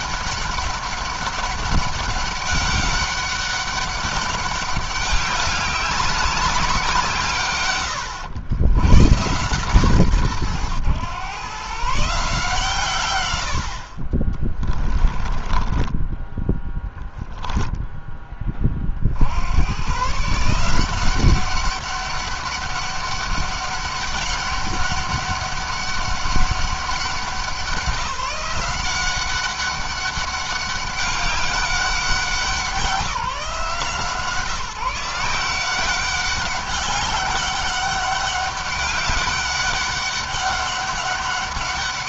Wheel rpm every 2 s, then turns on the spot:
200, 200, 200, 170, 90, 110, 130, 20, 10, 30, 170, 200, 200, 200, 190, 200, 180, 170, 190, 200, 200.
14-16